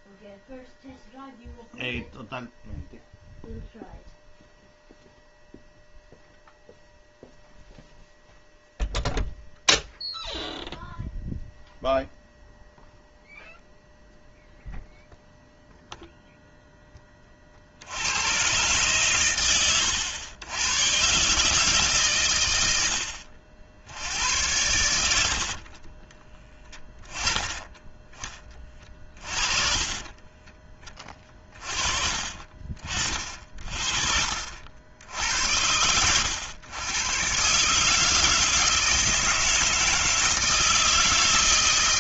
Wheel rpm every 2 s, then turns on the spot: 0, 0, 0, 0, 0, 0, 0, 0, 0, 120, 100, 110, 100, 20, 20, 20, 40, 70, 100, 160, 160.
none